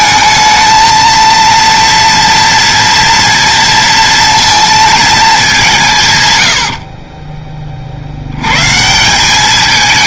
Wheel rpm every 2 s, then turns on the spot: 220, 230, 230, 50, 150.
none